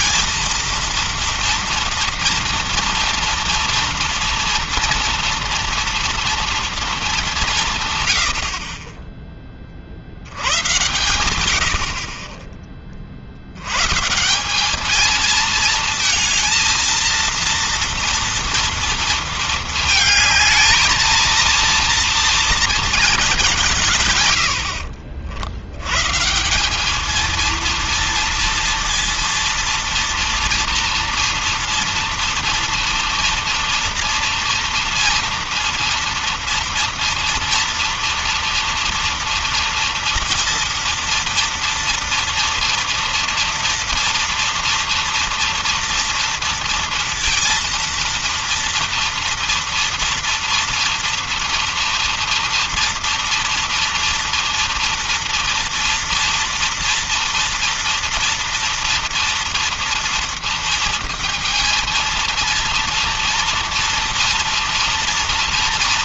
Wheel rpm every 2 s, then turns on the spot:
220, 230, 230, 230, 70, 90, 30, 180, 230, 230, 220, 230, 90, 170, 230, 230, 230, 230, 230, 240, 230, 230, 230, 230, 230, 230, 230, 230, 230, 230, 230, 230, 230.
none